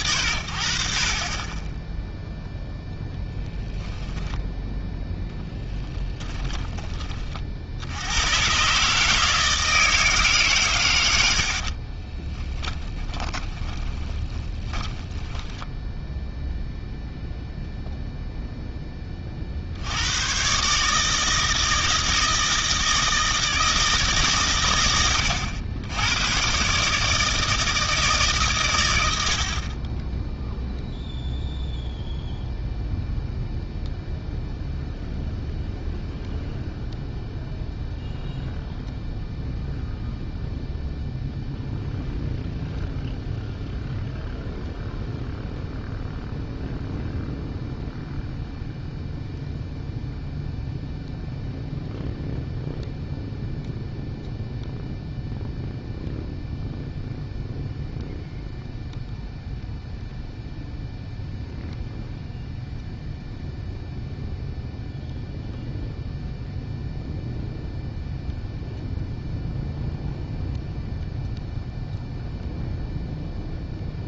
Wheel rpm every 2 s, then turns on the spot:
80, 0, 0, 20, 140, 120, 20, 20, 0, 0, 130, 160, 120, 140, 120, 0, 0, 0, 0, 0, 0, 0, 0, 0, 0, 0, 0, 0, 0, 0, 0, 0, 0, 0, 0, 0, 0.
6-8 12-16